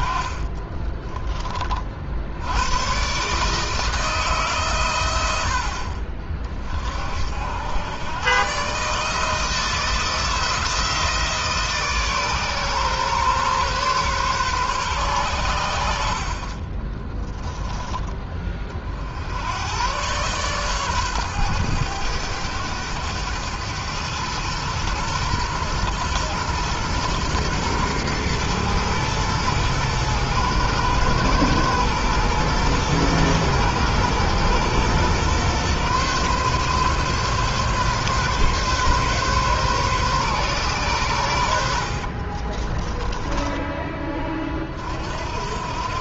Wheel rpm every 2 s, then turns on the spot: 30, 120, 120, 40, 140, 170, 140, 120, 20, 50, 130, 100, 110, 120, 120, 110, 120, 120, 130, 140, 120, 20, 50.
0-2 16-18 42-44